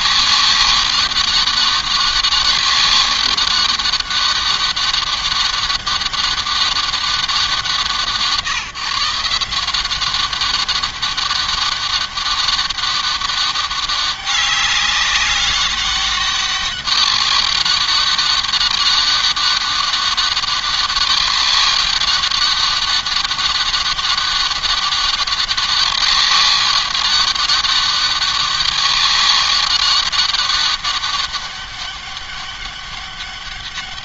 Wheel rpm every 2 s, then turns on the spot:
200, 200, 200, 190, 160, 200, 200, 200, 200, 200, 200, 200, 200, 200, 200, 200, 200.
none